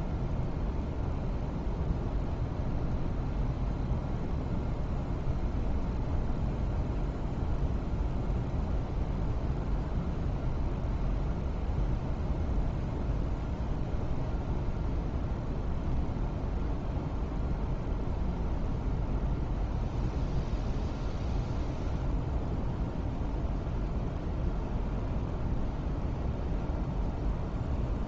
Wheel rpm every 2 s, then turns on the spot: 0, 0, 0, 0, 0, 0, 0, 0, 0, 0, 0, 0, 0, 0.
none